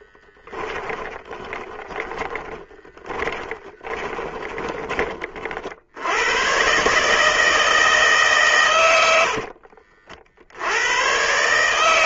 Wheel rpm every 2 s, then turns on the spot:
20, 20, 30, 140, 90, 90.
0-4 8-10